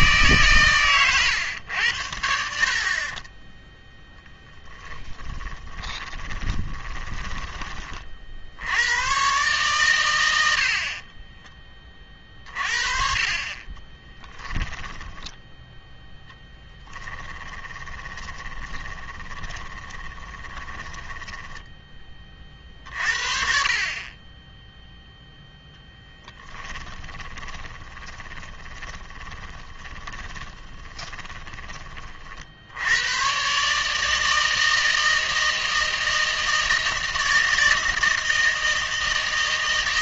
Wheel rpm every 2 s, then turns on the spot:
130, 50, 10, 20, 90, 70, 40, 10, 10, 20, 10, 50, 0, 20, 20, 20, 80, 160, 160, 160.
4-8 14-22 26-32